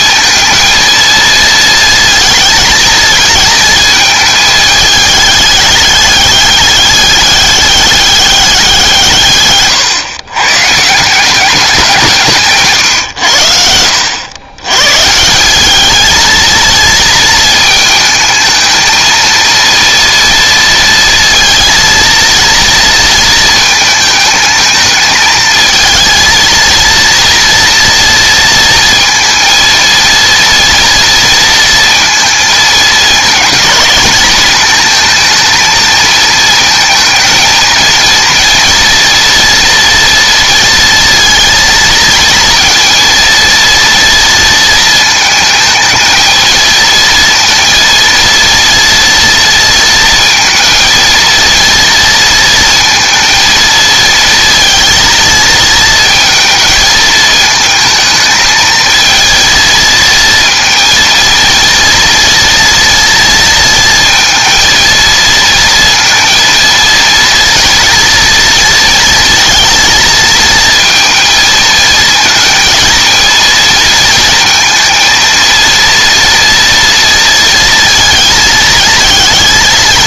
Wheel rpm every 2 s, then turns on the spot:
230, 220, 220, 200, 190, 140, 140, 110, 230, 220, 230, 230, 220, 230, 230, 230, 220, 220, 220, 230, 230, 230, 230, 230, 230, 220, 230, 230, 220, 220, 230, 230, 230, 230, 230, 230, 230, 230, 230, 220.
none